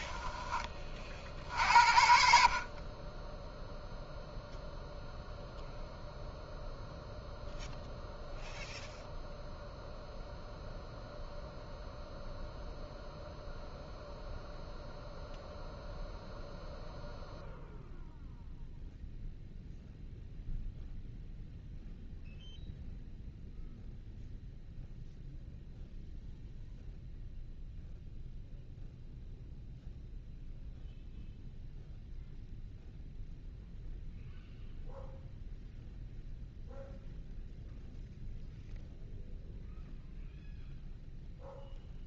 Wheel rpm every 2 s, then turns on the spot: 30, 30, 0, 0, 0, 0, 0, 0, 0, 0, 0, 0, 0, 0, 0, 0, 0, 0, 0, 0, 0.
none